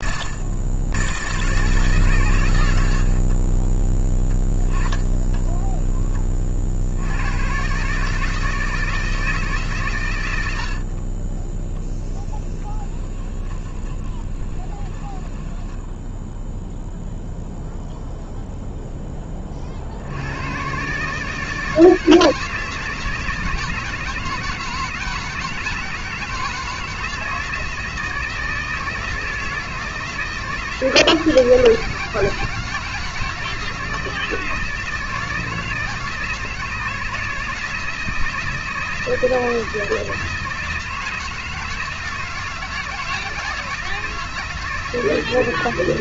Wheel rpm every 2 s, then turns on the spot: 110, 100, 20, 50, 160, 80, 10, 20, 0, 0, 110, 160, 160, 160, 160, 160, 160, 160, 160, 160, 160, 160, 160.
4-6 12-16